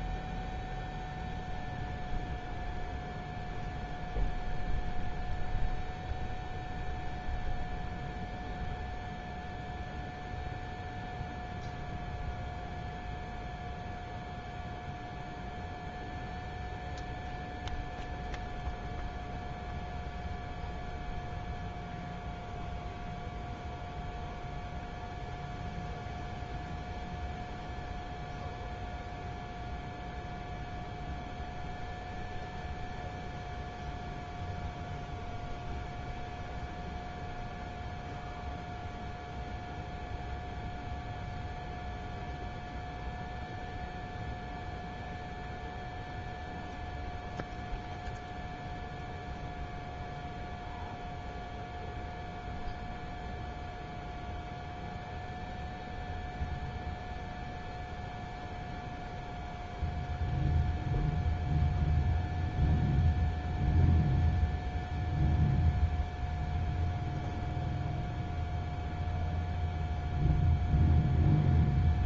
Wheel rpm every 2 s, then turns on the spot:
0, 0, 0, 0, 0, 0, 0, 0, 0, 0, 0, 0, 0, 0, 0, 0, 0, 0, 0, 0, 0, 0, 0, 0, 0, 0, 0, 0, 0, 0, 0, 0, 0, 0, 0, 0.
none